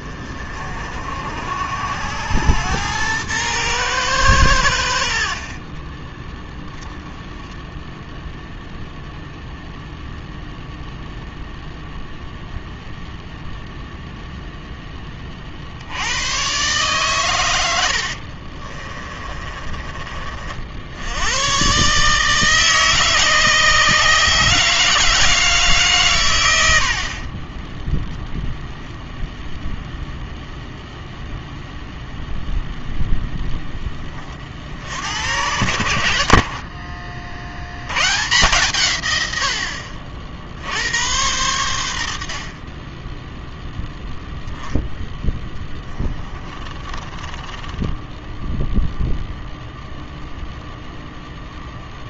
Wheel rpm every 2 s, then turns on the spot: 50, 100, 80, 10, 0, 0, 0, 10, 130, 40, 60, 150, 150, 90, 0, 0, 0, 50, 50, 130, 70, 40, 0, 10, 0, 0.
18-20 36-38 46-48